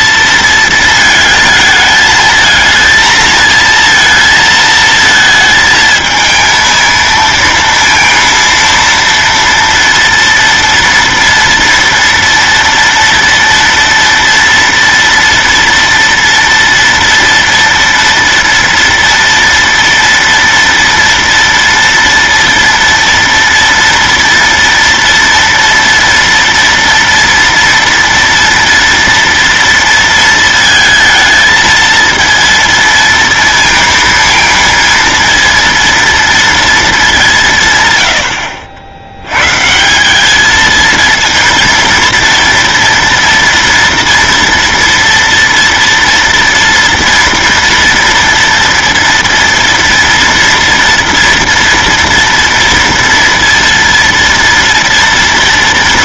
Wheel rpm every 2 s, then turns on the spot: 230, 220, 230, 220, 230, 230, 230, 230, 230, 230, 230, 230, 230, 230, 230, 220, 230, 230, 230, 70, 210, 240, 230, 230, 230, 230, 230, 230.
none